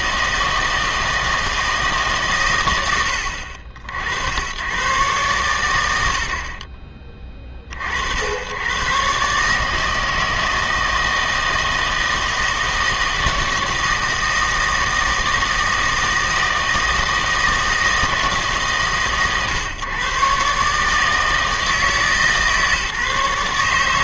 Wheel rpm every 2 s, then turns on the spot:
160, 110, 100, 40, 110, 160, 160, 160, 160, 140, 140, 150.
6-8